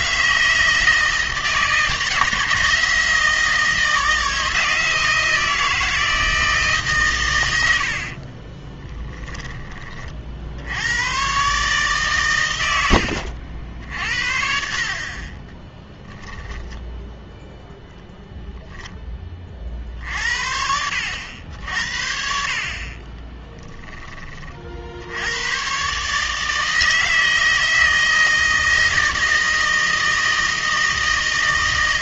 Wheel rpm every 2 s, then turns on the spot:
160, 160, 160, 140, 20, 100, 90, 50, 0, 10, 80, 30, 70, 160, 160, 160.
8-10